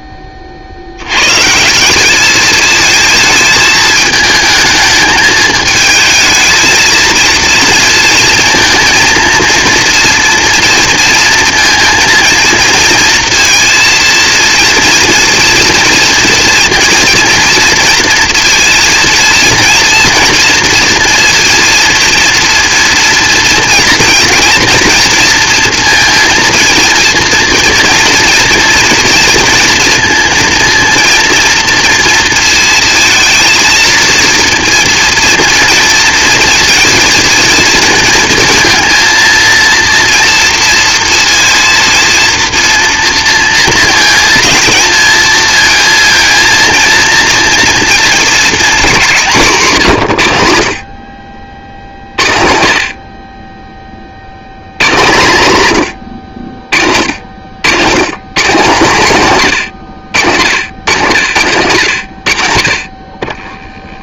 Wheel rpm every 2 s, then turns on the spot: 50, 220, 220, 220, 230, 230, 230, 230, 230, 230, 230, 230, 230, 230, 230, 230, 230, 230, 230, 230, 230, 230, 230, 230, 210, 90, 60, 100, 50, 160, 90, 60.
none